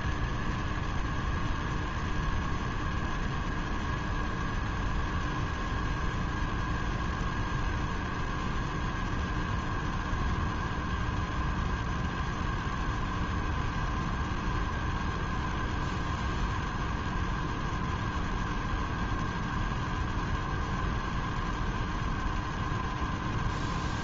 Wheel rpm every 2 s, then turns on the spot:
0, 0, 0, 0, 0, 0, 0, 0, 0, 0, 0, 0.
none